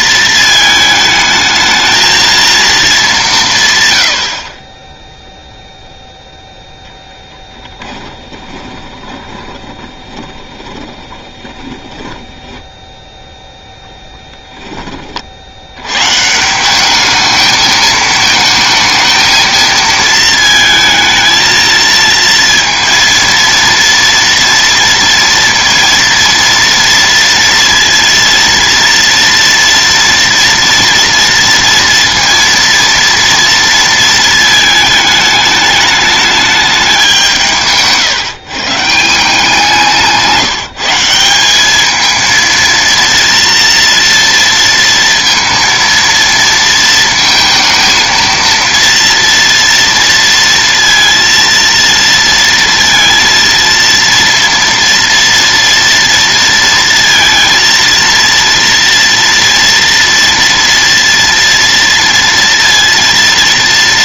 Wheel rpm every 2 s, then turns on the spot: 220, 230, 30, 0, 20, 30, 0, 30, 200, 220, 220, 230, 230, 230, 240, 230, 230, 210, 200, 170, 170, 230, 230, 230, 230, 230, 230, 230, 230, 230, 230, 230.
8-12